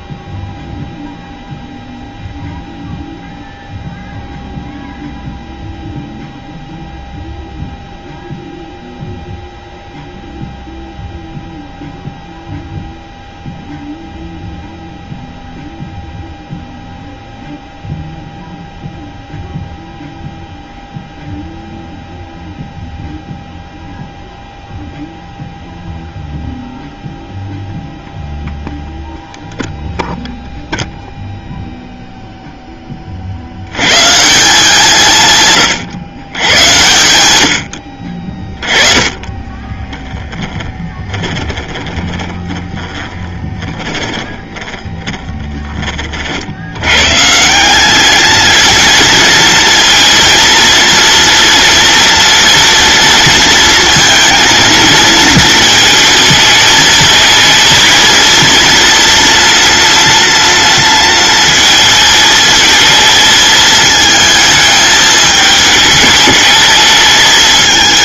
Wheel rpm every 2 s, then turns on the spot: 0, 0, 0, 0, 0, 0, 0, 0, 0, 0, 0, 0, 0, 0, 0, 0, 20, 170, 100, 20, 10, 10, 10, 120, 230, 230, 230, 220, 220, 240, 230, 220, 220, 220.
38-46